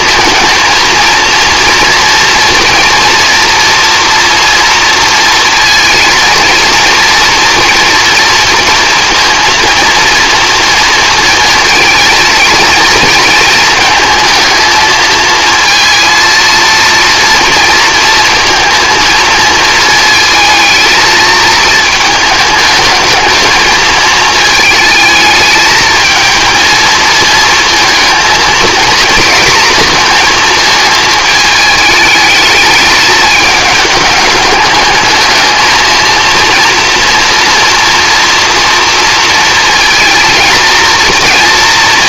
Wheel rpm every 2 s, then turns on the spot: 230, 230, 240, 230, 240, 230, 230, 220, 230, 230, 220, 220, 220, 230, 230, 220, 210, 210, 230, 230, 230.
none